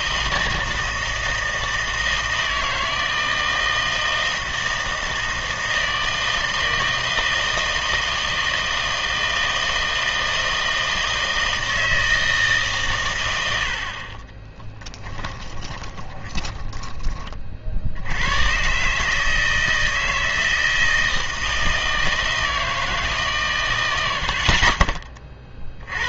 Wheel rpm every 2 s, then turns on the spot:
160, 160, 160, 160, 160, 160, 150, 20, 20, 120, 160, 160, 50.
14-18